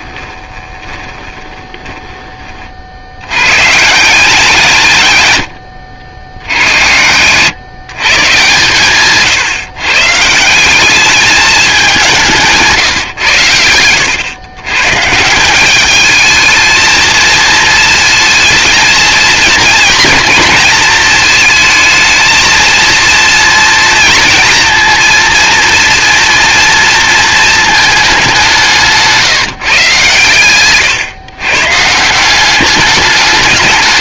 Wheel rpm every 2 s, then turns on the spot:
20, 50, 170, 80, 140, 180, 140, 130, 220, 230, 220, 230, 230, 230, 180, 120, 200.
0-2